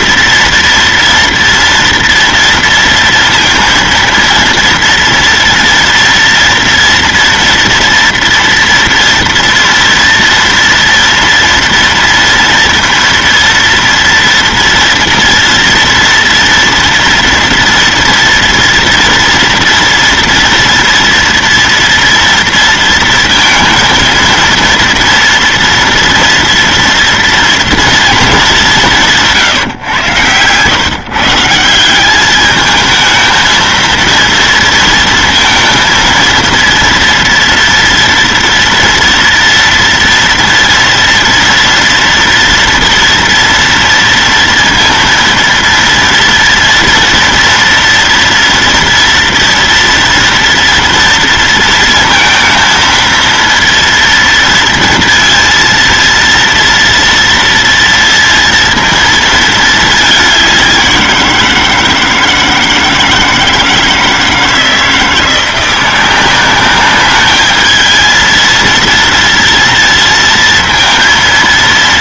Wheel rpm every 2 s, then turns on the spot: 230, 230, 230, 230, 230, 230, 230, 230, 230, 230, 230, 230, 230, 230, 190, 140, 220, 230, 230, 230, 230, 230, 230, 230, 230, 230, 230, 230, 230, 230, 190, 160, 160, 200, 230, 230.
none